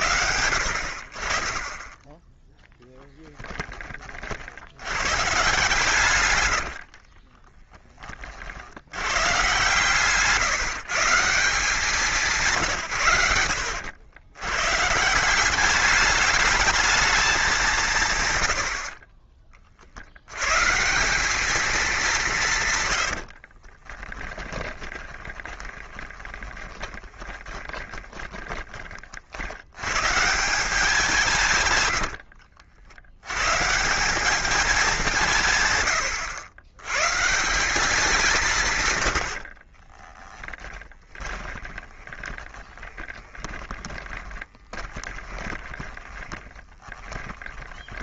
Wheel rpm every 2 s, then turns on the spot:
70, 10, 90, 70, 70, 160, 150, 120, 210, 90, 140, 140, 20, 20, 20, 170, 70, 200, 100, 150, 20, 20, 20, 10.
6-8 24-28 40-48